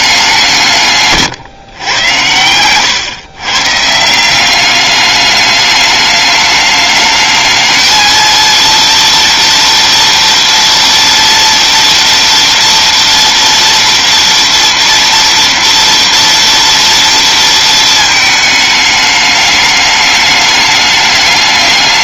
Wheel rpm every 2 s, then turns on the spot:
140, 130, 210, 220, 230, 230, 230, 230, 230, 210, 210.
none